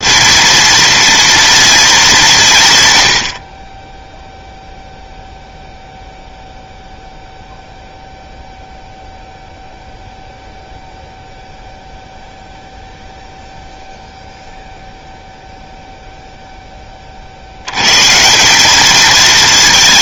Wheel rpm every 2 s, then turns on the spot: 230, 140, 0, 0, 0, 0, 0, 0, 0, 180.
none